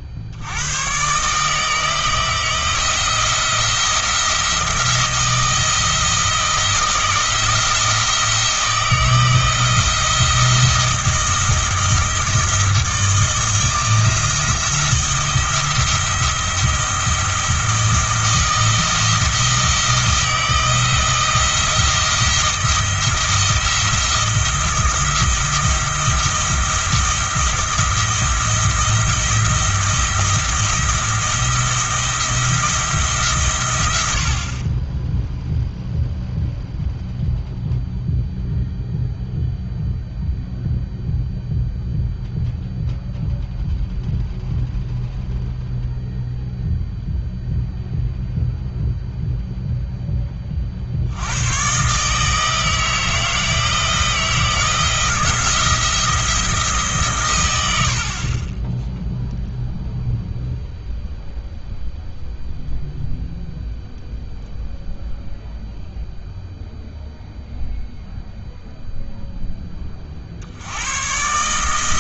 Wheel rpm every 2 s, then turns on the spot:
110, 160, 170, 170, 160, 170, 160, 170, 170, 160, 170, 170, 170, 170, 170, 170, 160, 30, 0, 0, 0, 0, 0, 0, 0, 60, 160, 170, 150, 10, 0, 0, 0, 0, 0, 100.
none